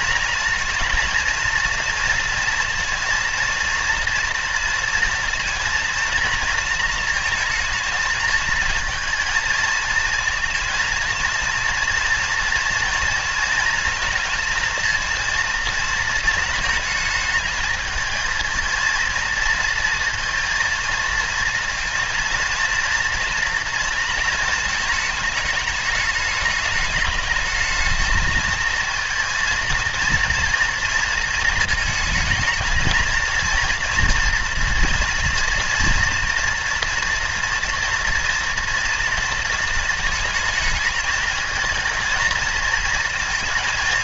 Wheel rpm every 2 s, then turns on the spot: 230, 230, 230, 230, 220, 220, 230, 230, 220, 230, 230, 230, 230, 210, 230, 230, 230, 240, 230, 240, 220, 220.
none